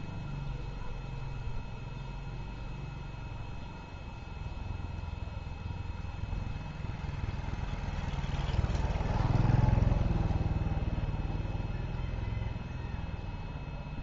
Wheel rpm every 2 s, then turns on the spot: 0, 0, 0, 0, 0, 0, 0.
none